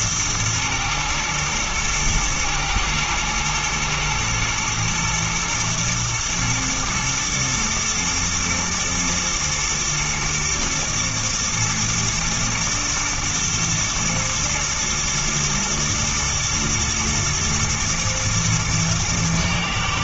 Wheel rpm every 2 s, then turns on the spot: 110, 110, 110, 110, 120, 120, 120, 110, 120, 120.
none